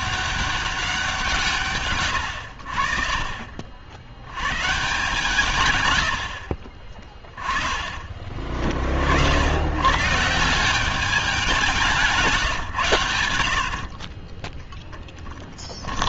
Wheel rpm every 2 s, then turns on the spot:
200, 70, 110, 40, 30, 170, 160, 20.
6-8